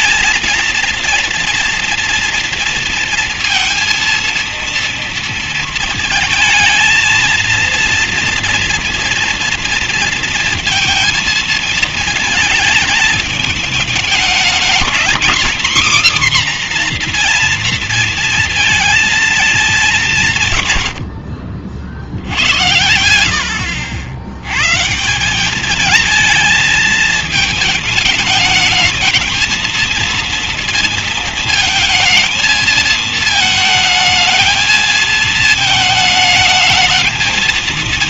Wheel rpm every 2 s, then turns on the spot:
230, 230, 230, 220, 230, 230, 230, 210, 260, 230, 190, 60, 80, 220, 220, 230, 220, 220, 220.
none